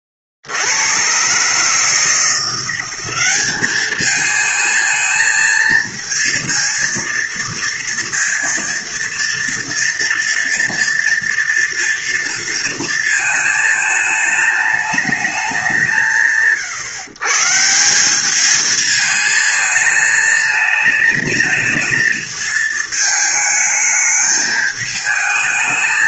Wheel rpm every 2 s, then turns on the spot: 70, 180, 220, 230, 230, 240, 230, 210, 120, 210, 220, 220, 220.
none